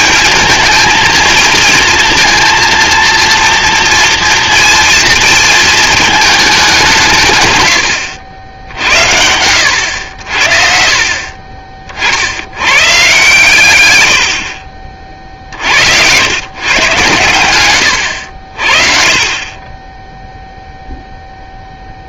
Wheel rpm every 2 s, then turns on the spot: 220, 230, 230, 180, 80, 50, 130, 60, 120, 40, 0.
none